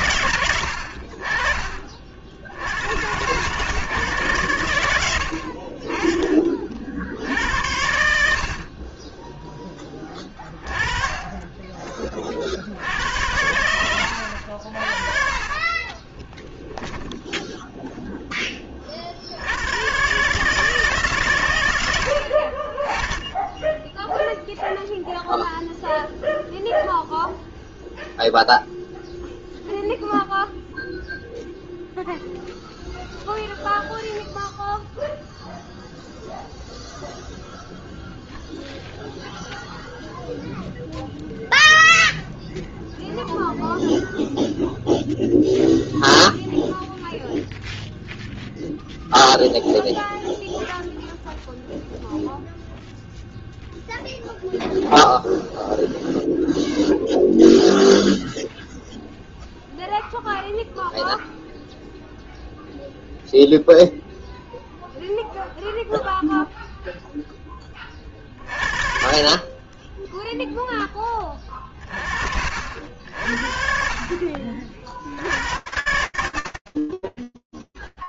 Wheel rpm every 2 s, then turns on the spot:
50, 100, 90, 40, 30, 30, 70, 50, 10, 40, 140, 10, 0, 0, 0, 0, 0, 0, 0, 0, 0, 0, 0, 0, 0, 0, 0, 0, 0, 0, 0, 0, 0, 0, 40, 20, 60, 80, 30.
10-12 14-18